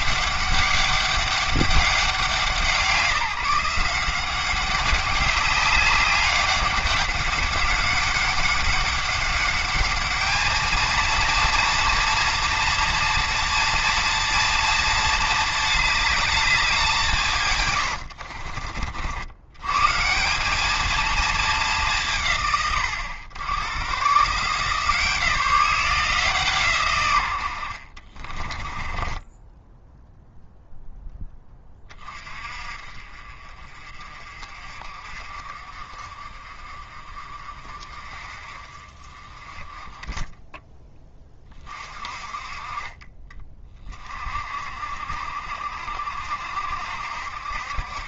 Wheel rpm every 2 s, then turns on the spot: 200, 160, 200, 200, 200, 220, 230, 230, 190, 60, 220, 100, 160, 120, 20, 10, 40, 40, 40, 30, 10, 30, 50, 60.
28-30